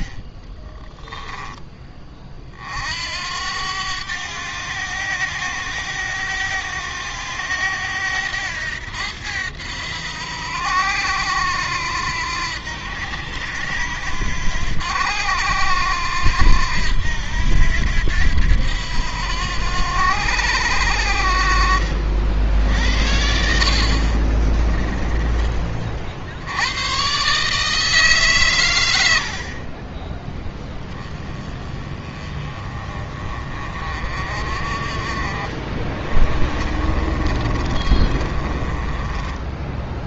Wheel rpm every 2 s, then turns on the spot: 20, 60, 100, 100, 90, 80, 80, 90, 80, 80, 80, 70, 20, 110, 110, 10, 30, 40, 30, 20.
0-2 24-26 36-40